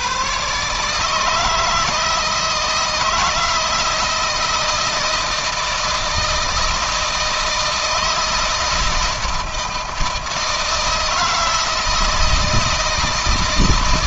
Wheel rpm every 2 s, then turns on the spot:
140, 160, 160, 160, 160, 160, 160.
none